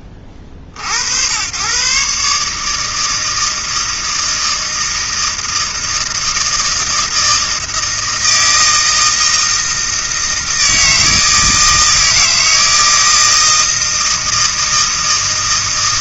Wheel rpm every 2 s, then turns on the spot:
70, 150, 160, 160, 160, 160, 160, 160.
none